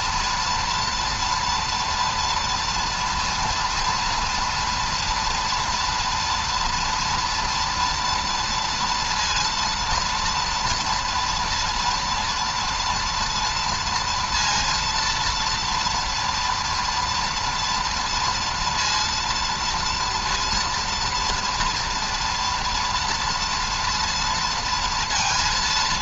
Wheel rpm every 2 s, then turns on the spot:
230, 230, 230, 230, 230, 230, 230, 230, 230, 230, 240, 240, 230.
none